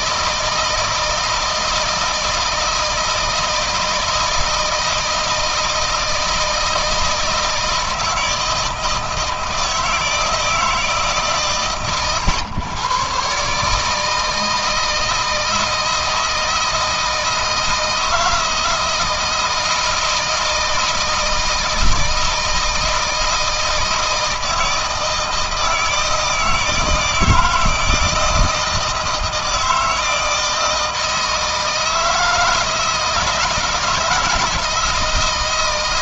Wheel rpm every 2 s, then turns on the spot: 160, 160, 160, 160, 160, 150, 120, 160, 160, 170, 160, 160, 160, 160, 160, 160, 160, 160.
none